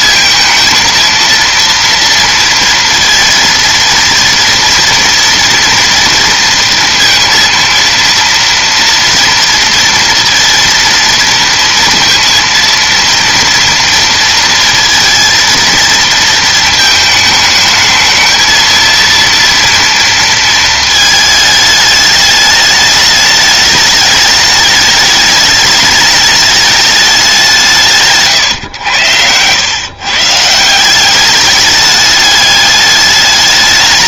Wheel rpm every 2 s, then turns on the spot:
230, 230, 230, 230, 230, 230, 230, 230, 220, 220, 230, 210, 210, 210, 130, 160, 210.
28-30